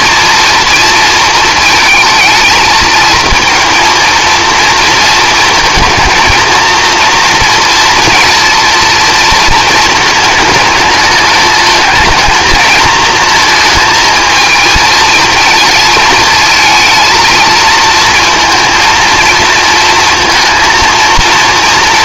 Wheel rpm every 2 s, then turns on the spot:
230, 220, 230, 230, 230, 210, 230, 230, 220, 230, 230.
none